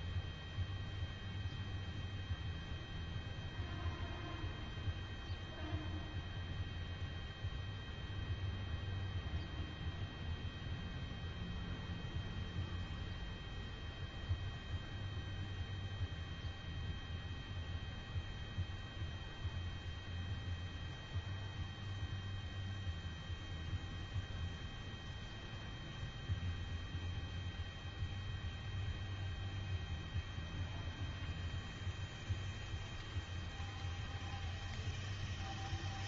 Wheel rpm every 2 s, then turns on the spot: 0, 0, 0, 0, 0, 0, 0, 0, 0, 0, 0, 0, 0, 0, 0, 0, 0, 0.
none